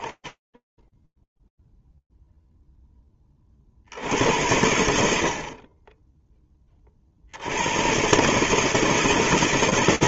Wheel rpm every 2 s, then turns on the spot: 20, 0, 80, 20, 150.
none